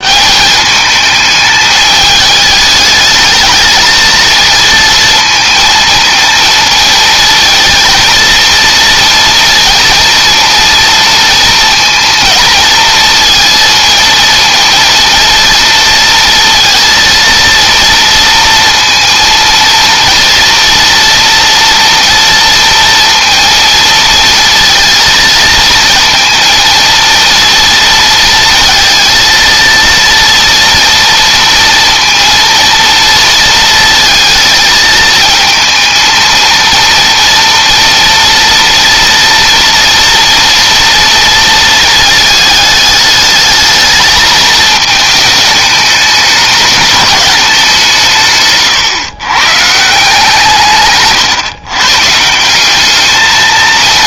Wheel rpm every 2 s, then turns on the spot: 210, 220, 230, 230, 230, 230, 230, 230, 230, 230, 240, 230, 230, 230, 230, 230, 230, 220, 230, 230, 230, 210, 220, 220, 130, 130, 210.
none